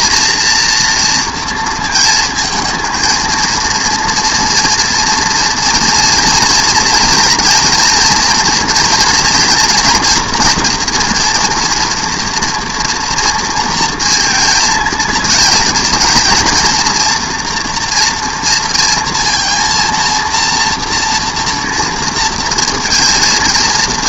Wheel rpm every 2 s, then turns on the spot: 230, 230, 230, 230, 230, 230, 230, 230, 240, 230, 230, 230.
none